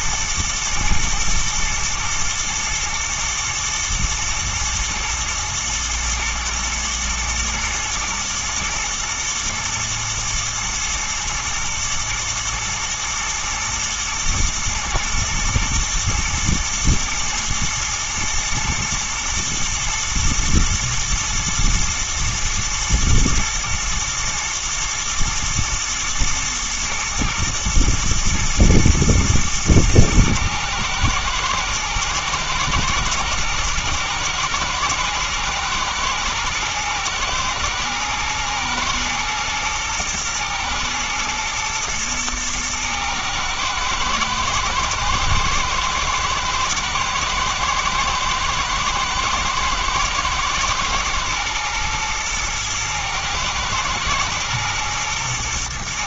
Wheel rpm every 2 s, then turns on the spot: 120, 120, 110, 110, 120, 120, 120, 110, 120, 120, 110, 110, 110, 110, 120, 120, 120, 110, 110, 110, 110, 110, 110, 110, 110, 110, 120, 120.
none